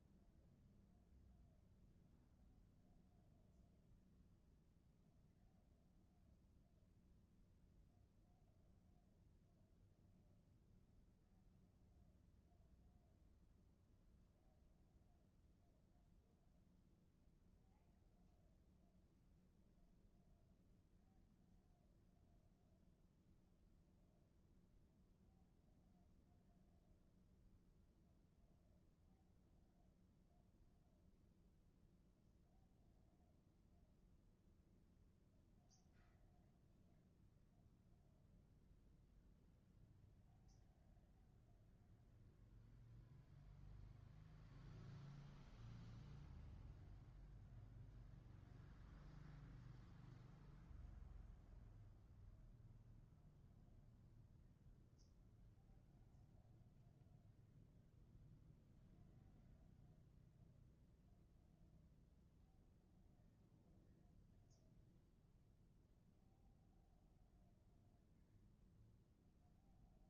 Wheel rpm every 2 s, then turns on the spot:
0, 0, 0, 0, 0, 0, 0, 0, 0, 0, 0, 0, 0, 0, 0, 0, 0, 0, 0, 0, 0, 0, 0, 0, 0, 0, 0, 0, 0, 0, 0, 0, 0, 0, 0.
none